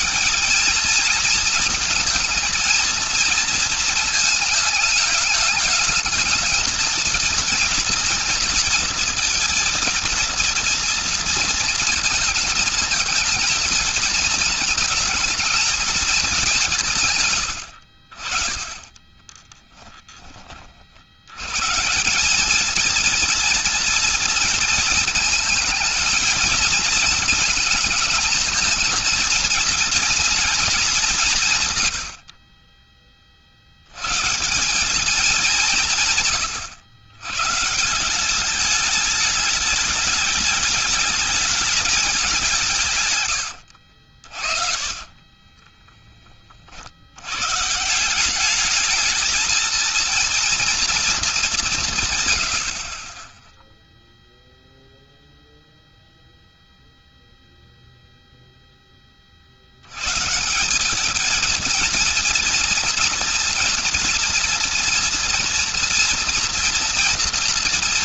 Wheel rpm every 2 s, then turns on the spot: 220, 230, 210, 230, 230, 230, 220, 220, 160, 20, 30, 200, 230, 220, 220, 220, 20, 150, 110, 200, 210, 180, 40, 40, 200, 230, 90, 0, 0, 0, 160, 230, 240, 240.
18-20 44-46